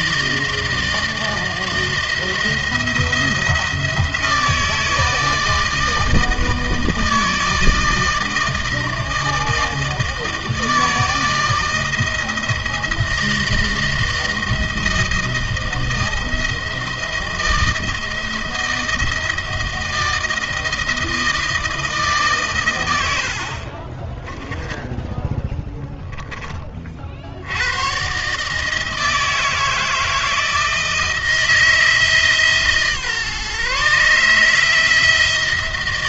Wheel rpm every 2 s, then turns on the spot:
160, 170, 160, 160, 160, 160, 160, 160, 170, 160, 160, 110, 10, 40, 150, 160, 150, 160.
none